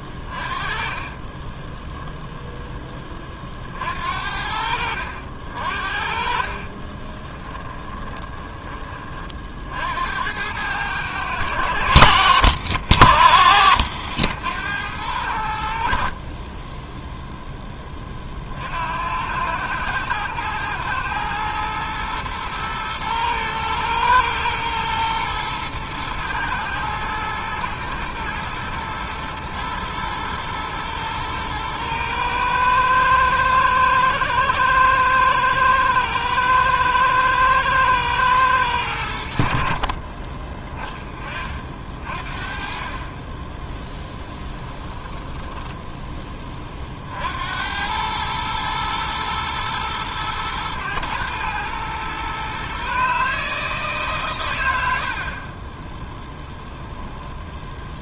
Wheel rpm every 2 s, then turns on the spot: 30, 10, 60, 30, 30, 100, 70, 90, 10, 80, 110, 110, 110, 110, 120, 110, 110, 110, 110, 100, 30, 30, 10, 30, 110, 120, 130, 80, 10.
0-2 6-8 16-18 44-46 56-58